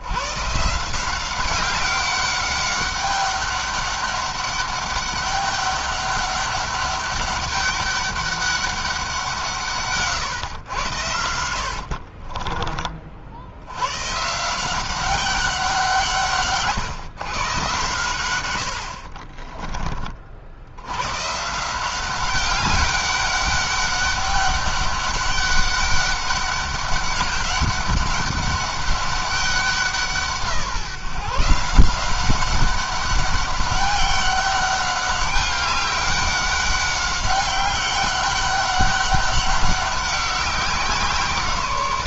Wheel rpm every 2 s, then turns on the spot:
160, 200, 200, 200, 190, 110, 30, 170, 150, 70, 80, 200, 200, 200, 200, 160, 200, 200, 200, 200, 180.
18-20